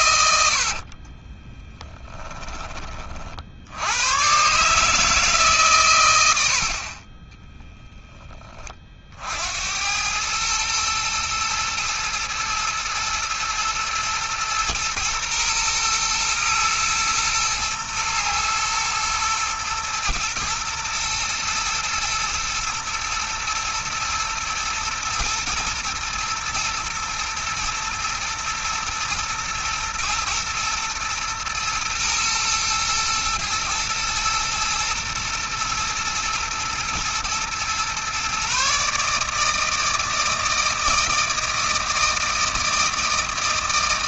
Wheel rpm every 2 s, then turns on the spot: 30, 40, 150, 40, 50, 110, 120, 120, 110, 110, 110, 110, 120, 110, 120, 110, 110, 120, 120, 150, 160, 160.
0-2 6-8